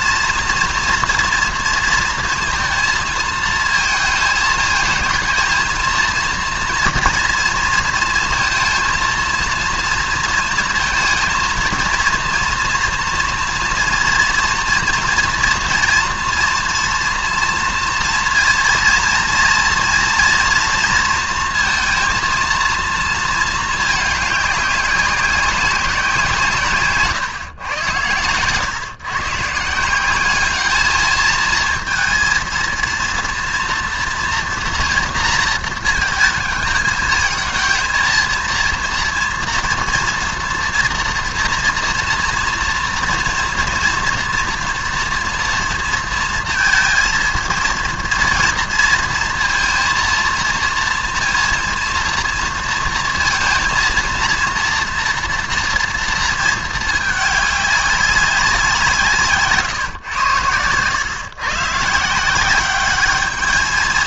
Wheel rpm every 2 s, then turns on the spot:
230, 230, 220, 230, 230, 230, 230, 230, 230, 240, 230, 230, 200, 140, 120, 210, 230, 230, 220, 230, 230, 230, 230, 230, 230, 230, 230, 230, 220, 170, 120, 200.
none